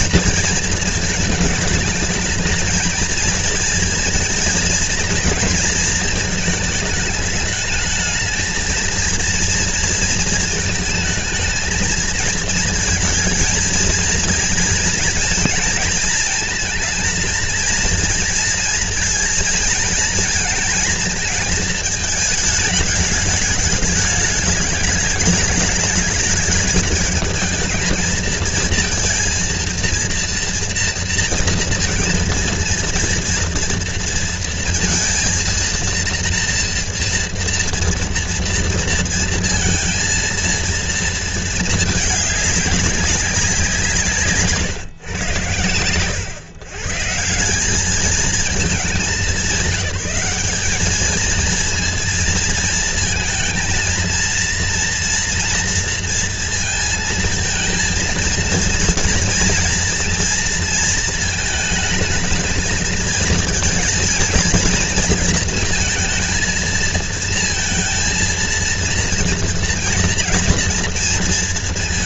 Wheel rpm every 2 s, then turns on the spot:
220, 220, 230, 220, 230, 220, 230, 230, 220, 220, 230, 220, 210, 210, 230, 230, 230, 230, 230, 230, 230, 200, 120, 140, 200, 200, 230, 230, 230, 230, 230, 220, 230, 220, 230, 230.
none